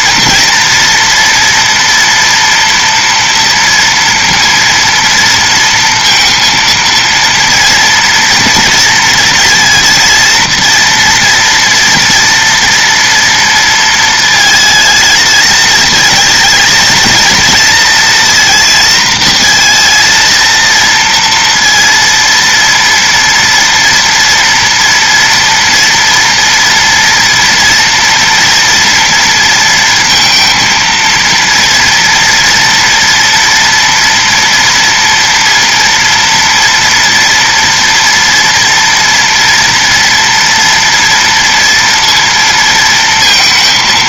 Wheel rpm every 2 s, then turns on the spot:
230, 240, 230, 230, 230, 230, 230, 220, 230, 230, 230, 230, 230, 230, 230, 230, 240, 230, 230, 230, 230, 230.
none